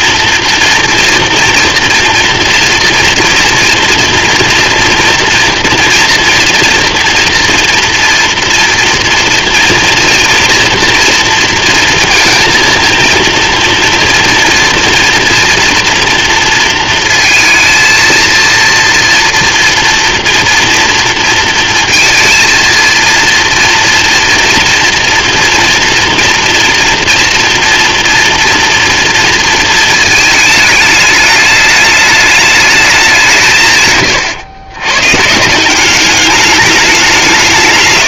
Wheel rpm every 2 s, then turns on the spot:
230, 230, 230, 240, 230, 230, 230, 230, 230, 230, 230, 230, 230, 230, 230, 220, 210, 120, 200.
none